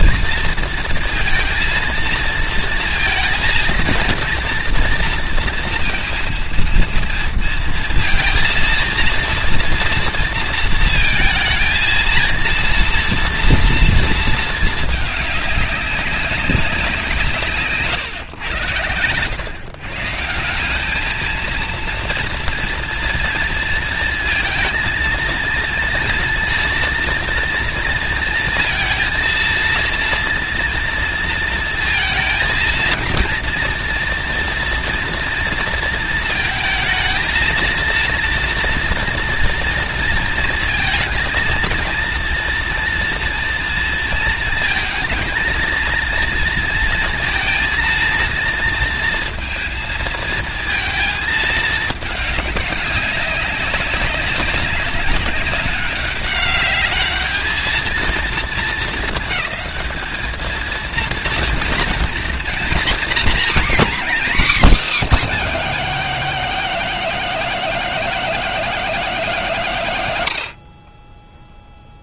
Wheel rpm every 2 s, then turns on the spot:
230, 230, 230, 230, 230, 230, 230, 210, 160, 100, 220, 230, 230, 230, 230, 230, 230, 230, 220, 230, 230, 240, 230, 230, 230, 220, 200, 200, 210, 220, 230, 250, 280, 270, 260, 20.
none